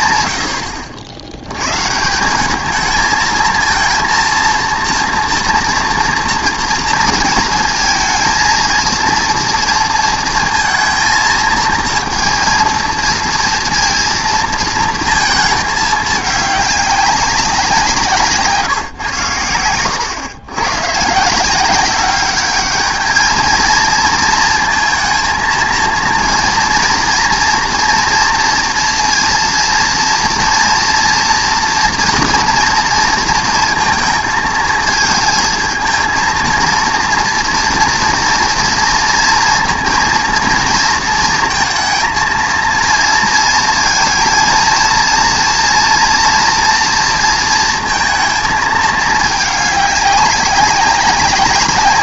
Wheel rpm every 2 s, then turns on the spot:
100, 200, 230, 230, 230, 230, 230, 230, 200, 150, 110, 200, 230, 230, 230, 230, 240, 230, 230, 230, 230, 230, 230, 230, 220, 200.
none